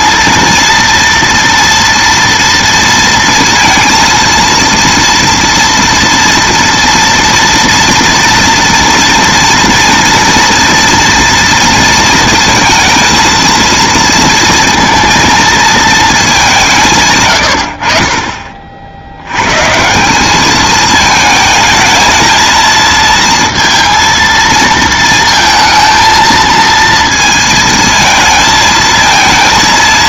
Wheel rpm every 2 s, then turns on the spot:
230, 230, 230, 230, 230, 230, 230, 230, 170, 50, 210, 220, 230, 230, 230.
none